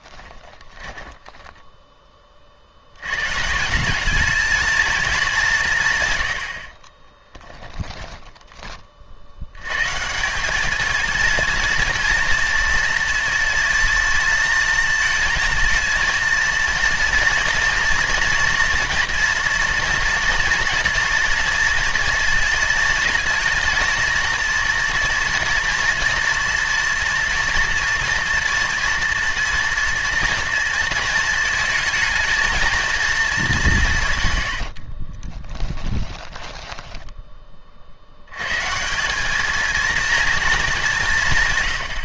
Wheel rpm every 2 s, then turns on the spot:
10, 60, 220, 40, 20, 220, 240, 230, 230, 240, 230, 220, 230, 230, 240, 230, 230, 60, 10, 140, 190.
0-2 6-8 34-38